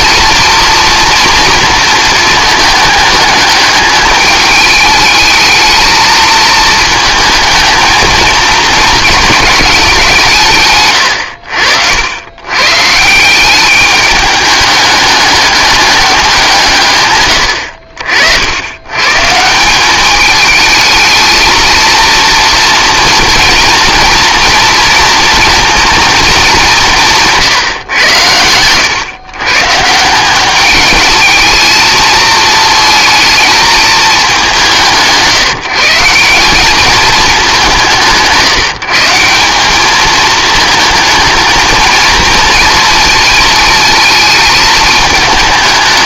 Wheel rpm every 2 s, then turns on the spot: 230, 210, 220, 220, 220, 90, 180, 210, 100, 150, 220, 240, 230, 160, 130, 220, 220, 180, 210, 180, 220, 220, 210.
10-12